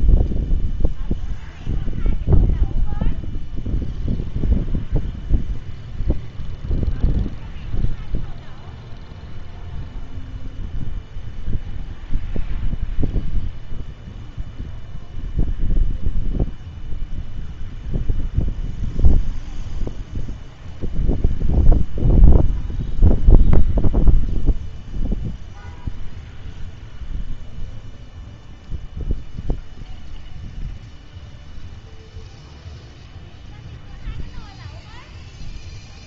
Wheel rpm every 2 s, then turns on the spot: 0, 0, 0, 0, 0, 0, 0, 0, 0, 0, 0, 0, 0, 0, 0, 0, 0, 0.
none